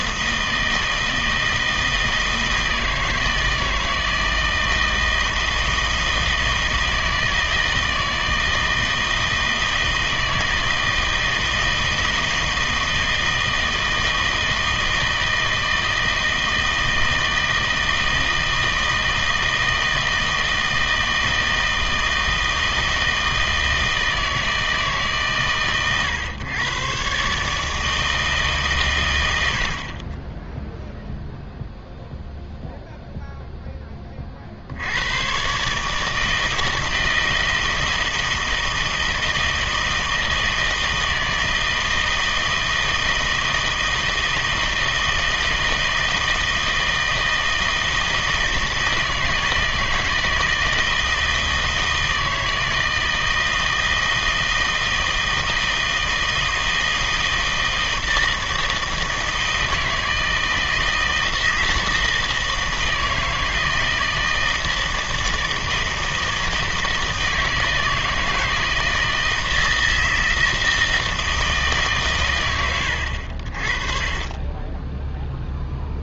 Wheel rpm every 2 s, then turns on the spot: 160, 160, 160, 160, 160, 160, 160, 160, 160, 160, 160, 160, 160, 120, 130, 0, 0, 80, 160, 160, 160, 160, 160, 160, 160, 160, 160, 160, 160, 160, 160, 160, 160, 160, 160, 160, 90, 10.
none